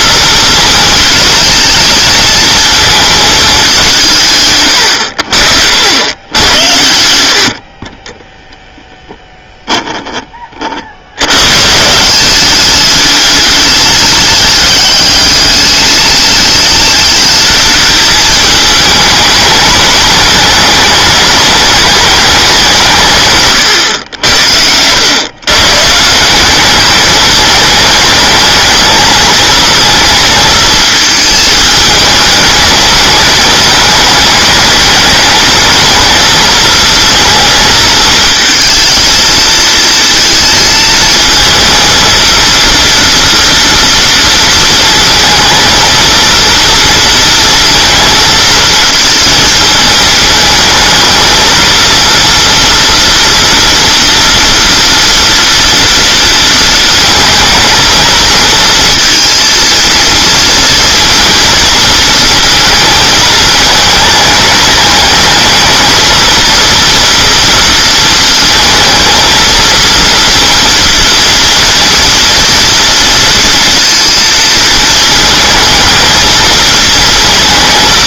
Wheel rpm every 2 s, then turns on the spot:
220, 220, 120, 90, 0, 50, 200, 210, 210, 210, 210, 190, 90, 200, 210, 220, 210, 210, 230, 230, 220, 230, 230, 230, 230, 220, 230, 240, 230, 230, 230, 220, 210, 230, 230, 230, 230, 220, 230.
4-6